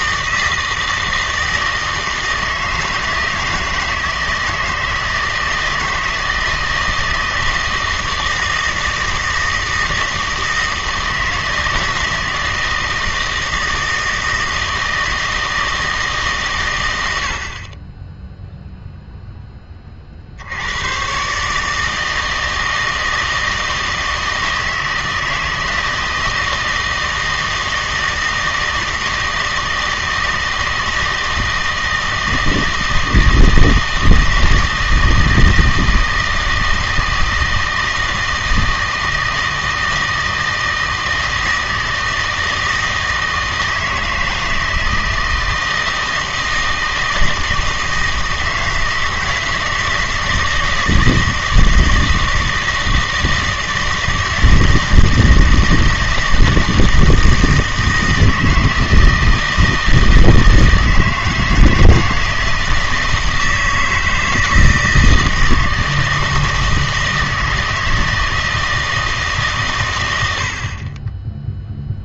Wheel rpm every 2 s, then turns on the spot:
160, 160, 160, 160, 160, 160, 160, 160, 120, 0, 90, 160, 160, 160, 160, 160, 160, 160, 160, 160, 160, 160, 160, 160, 160, 160, 160, 160, 160, 160, 160, 160, 160, 160, 160, 110.
none